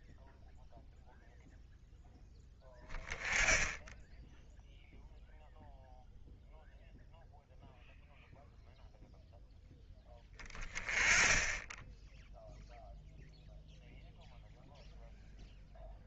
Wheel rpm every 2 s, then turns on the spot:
0, 10, 0, 0, 0, 20, 0, 0.
none